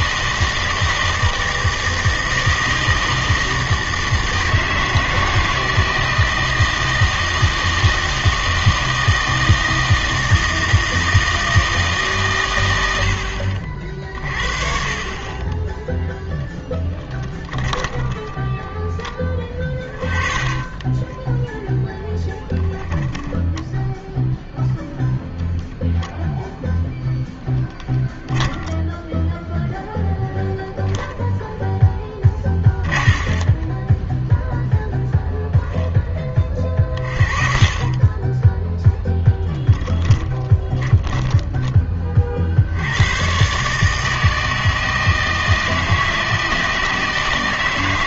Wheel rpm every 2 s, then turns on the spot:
160, 160, 160, 160, 160, 160, 110, 40, 10, 10, 20, 10, 0, 0, 0, 0, 30, 10, 40, 10, 10, 70, 160, 160.
20-24 32-42